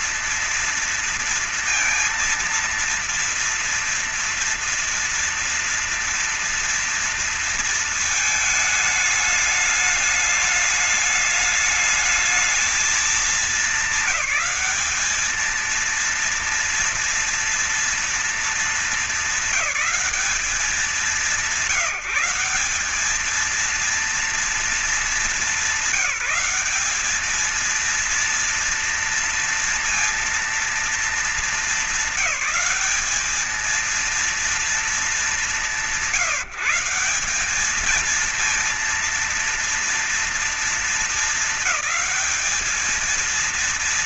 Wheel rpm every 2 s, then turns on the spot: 230, 230, 230, 230, 220, 210, 220, 200, 230, 230, 200, 190, 220, 200, 230, 230, 210, 220, 160, 230, 230, 220.
none